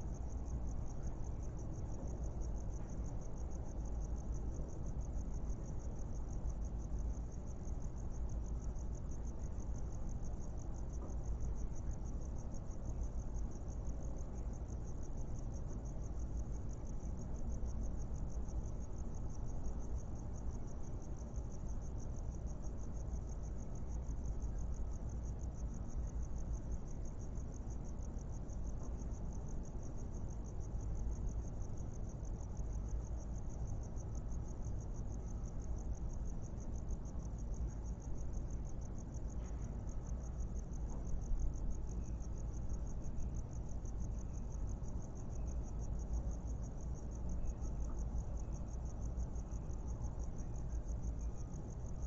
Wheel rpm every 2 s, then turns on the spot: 0, 0, 0, 0, 0, 0, 0, 0, 0, 0, 0, 0, 0, 0, 0, 0, 0, 0, 0, 0, 0, 0, 0, 0, 0, 0.
none